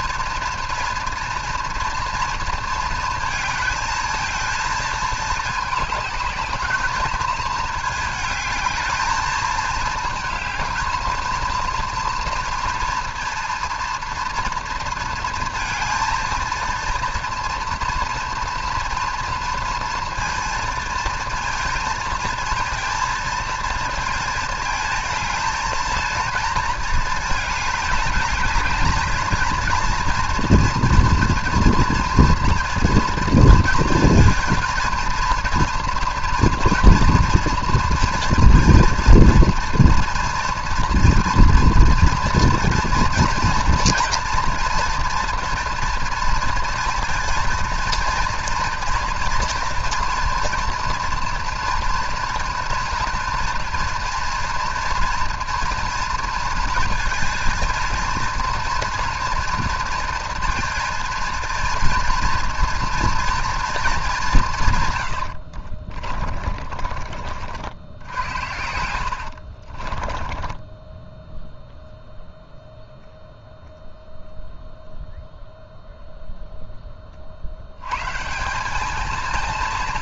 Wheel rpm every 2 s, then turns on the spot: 240, 230, 220, 210, 220, 220, 240, 230, 230, 240, 230, 220, 220, 220, 220, 230, 230, 230, 230, 230, 230, 230, 230, 230, 230, 240, 240, 230, 230, 230, 230, 230, 160, 50, 80, 10, 0, 0, 0, 190.
66-72